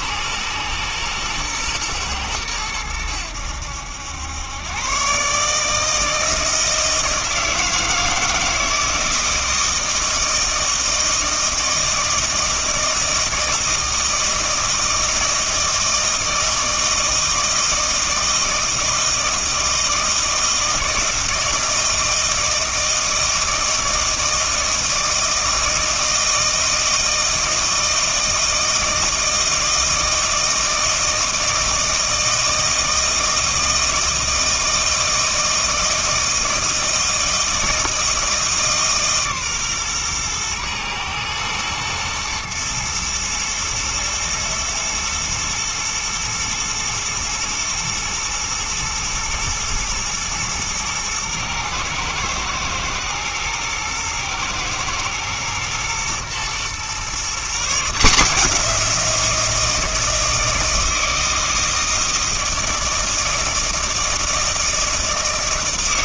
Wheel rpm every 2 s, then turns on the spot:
120, 100, 120, 160, 160, 160, 160, 160, 160, 160, 160, 160, 160, 160, 160, 160, 160, 160, 160, 150, 120, 110, 110, 110, 110, 120, 110, 120, 120, 170, 160, 160, 160.
none